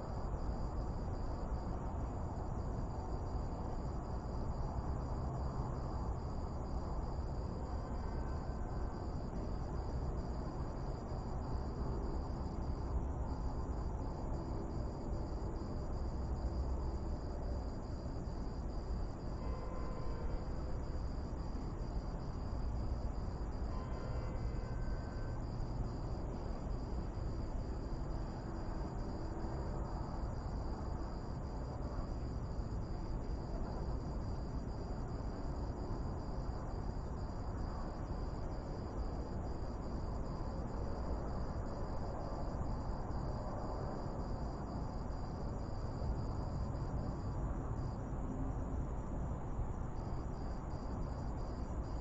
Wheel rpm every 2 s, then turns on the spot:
0, 0, 0, 0, 0, 0, 0, 0, 0, 0, 0, 0, 0, 0, 0, 0, 0, 0, 0, 0, 0, 0, 0, 0, 0, 0.
none